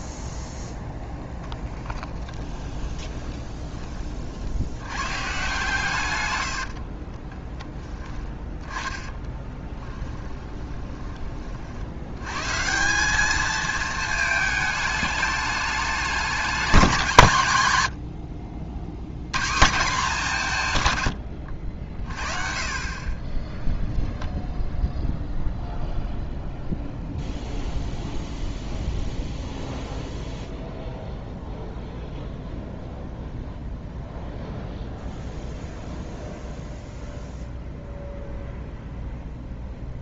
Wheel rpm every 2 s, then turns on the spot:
20, 20, 80, 60, 10, 20, 160, 210, 190, 60, 150, 40, 10, 0, 0, 0, 0, 0, 0, 0.
0-4 6-8 10-12 22-24